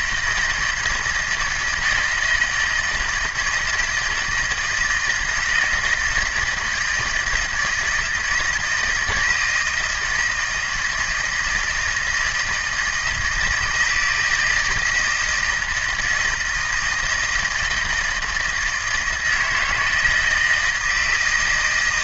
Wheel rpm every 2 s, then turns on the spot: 160, 160, 160, 160, 160, 160, 160, 160, 160, 160, 170.
none